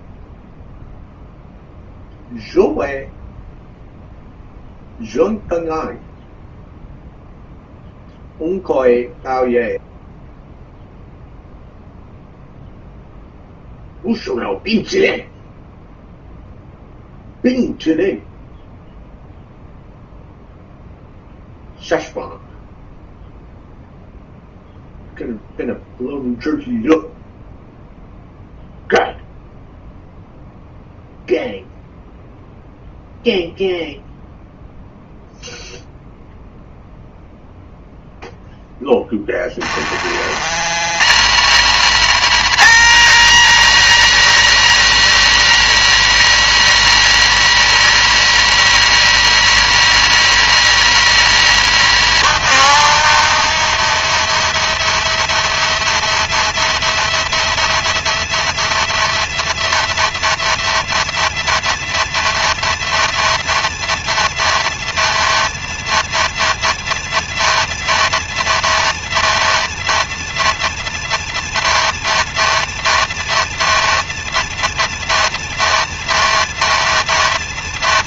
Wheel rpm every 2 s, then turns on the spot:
0, 0, 0, 0, 0, 0, 0, 0, 0, 0, 0, 0, 0, 0, 0, 0, 0, 0, 0, 20, 150, 200, 200, 200, 200, 200, 200, 200, 200, 200, 200, 200, 200, 200, 200, 210, 210, 210, 190.
38-40